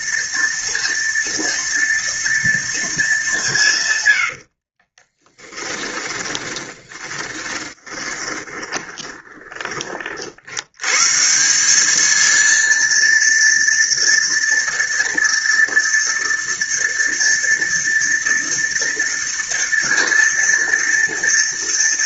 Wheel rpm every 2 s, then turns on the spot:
230, 220, 40, 10, 20, 110, 230, 240, 230, 230, 230.
4-10